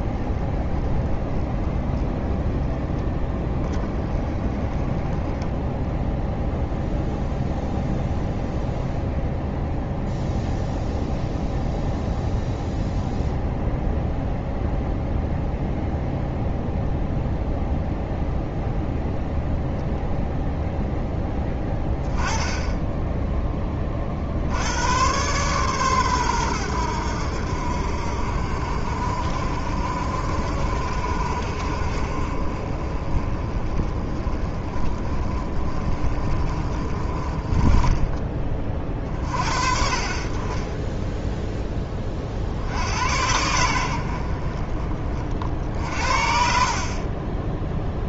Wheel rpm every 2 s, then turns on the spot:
10, 10, 10, 0, 0, 0, 0, 0, 0, 0, 0, 10, 90, 90, 50, 50, 40, 40, 30, 40, 10, 80, 40, 40.
none